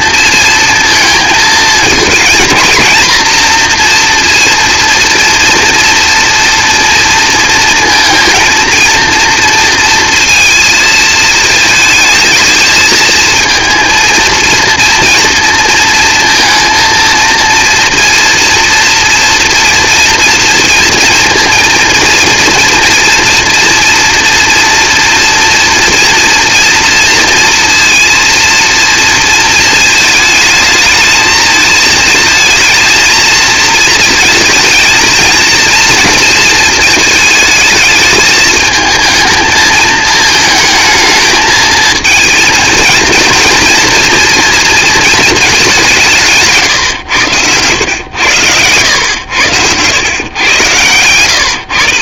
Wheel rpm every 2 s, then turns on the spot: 230, 230, 230, 230, 230, 230, 220, 230, 230, 230, 230, 230, 240, 230, 230, 220, 220, 230, 220, 220, 220, 230, 230, 130, 100, 120.
46-48